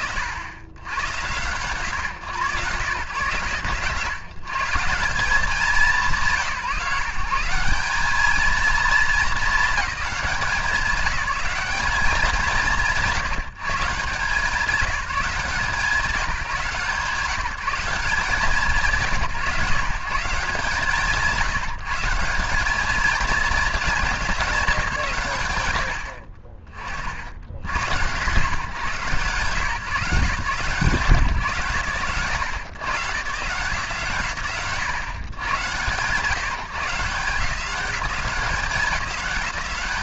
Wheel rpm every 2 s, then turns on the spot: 90, 130, 160, 160, 210, 200, 150, 190, 170, 160, 150, 220, 150, 60, 140, 140, 130, 110, 160, 190.
none